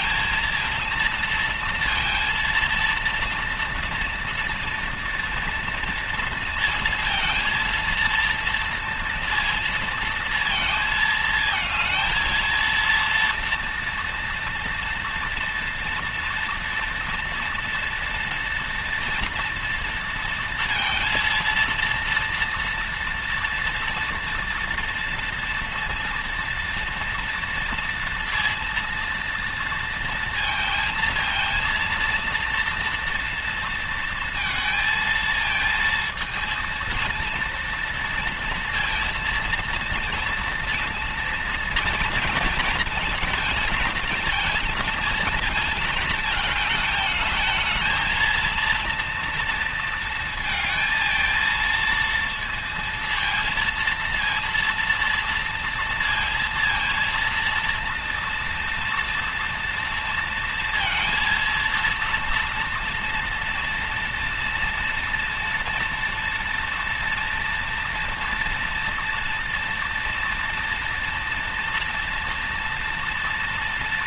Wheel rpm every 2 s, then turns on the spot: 230, 230, 230, 230, 230, 230, 230, 230, 230, 230, 230, 230, 230, 230, 230, 220, 230, 220, 230, 230, 230, 230, 230, 220, 230, 230, 230, 230, 230, 230, 230, 230, 230, 230, 230, 230, 230.
none